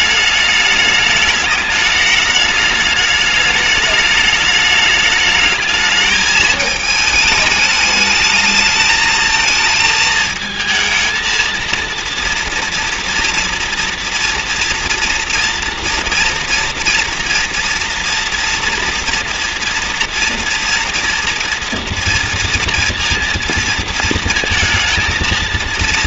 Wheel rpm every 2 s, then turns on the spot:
210, 210, 210, 220, 210, 220, 230, 230, 240, 230, 230, 230, 220.
none